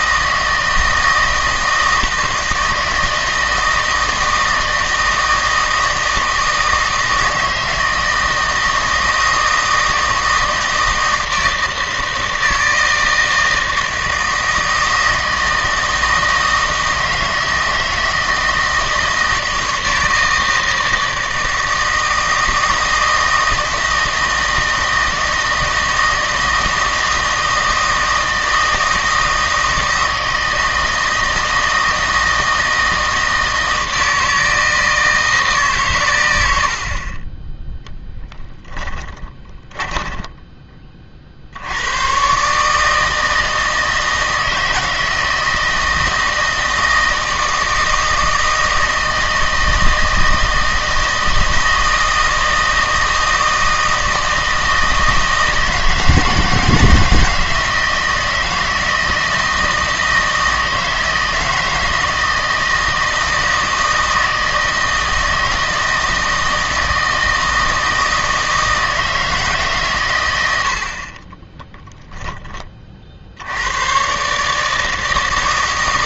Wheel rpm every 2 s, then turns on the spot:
160, 160, 160, 160, 160, 160, 160, 160, 160, 160, 160, 160, 160, 160, 160, 160, 160, 160, 60, 10, 30, 160, 160, 160, 160, 160, 160, 160, 160, 160, 160, 160, 160, 160, 160, 70, 30, 160.
38-40